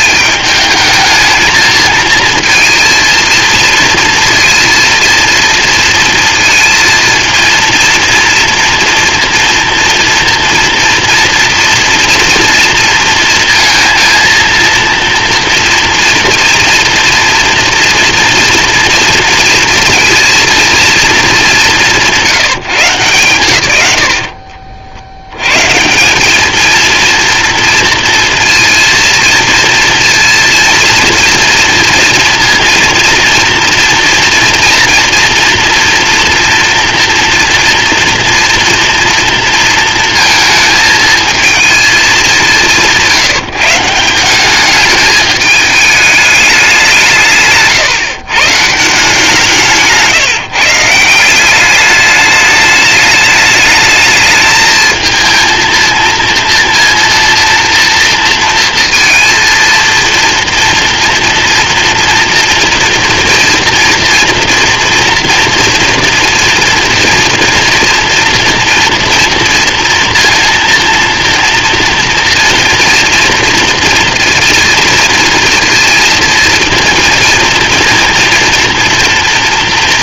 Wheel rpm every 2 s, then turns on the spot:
210, 230, 230, 230, 240, 230, 230, 230, 240, 240, 230, 160, 50, 220, 230, 230, 230, 230, 240, 230, 220, 180, 200, 200, 150, 150, 210, 220, 230, 230, 230, 230, 240, 230, 230, 230, 230, 230, 230, 240.
none